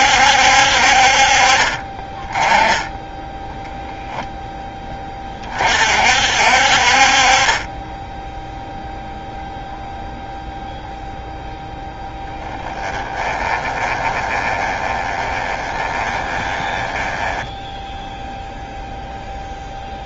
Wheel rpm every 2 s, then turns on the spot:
60, 10, 0, 50, 0, 0, 10, 20, 10, 0.
12-18